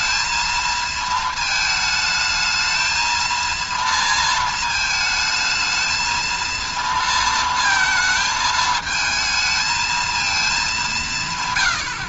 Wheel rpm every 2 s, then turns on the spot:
230, 220, 220, 230, 220, 210.
none